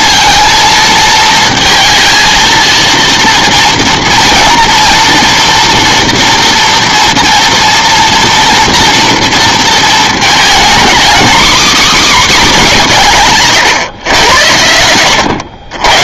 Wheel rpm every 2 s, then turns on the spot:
220, 230, 230, 240, 230, 250, 240, 90.
none